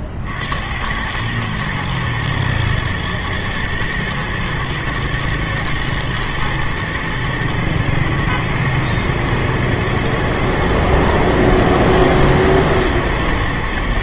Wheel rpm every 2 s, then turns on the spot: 80, 110, 120, 110, 110, 110, 110.
none